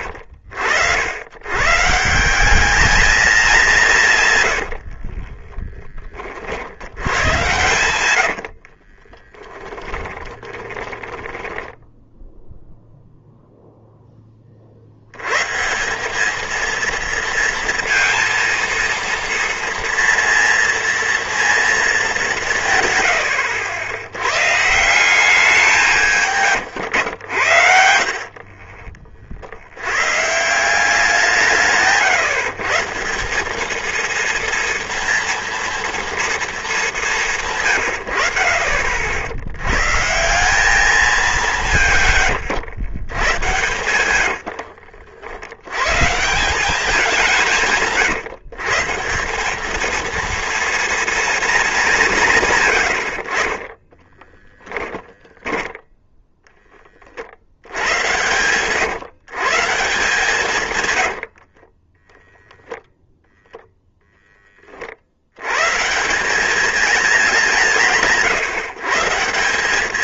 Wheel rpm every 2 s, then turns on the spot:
80, 200, 70, 70, 40, 10, 0, 60, 230, 230, 230, 140, 160, 120, 40, 160, 150, 230, 210, 60, 190, 110, 70, 190, 150, 230, 130, 20, 20, 130, 130, 0, 30, 210, 150.
4-6 8-12 38-40 42-46 54-56 60-62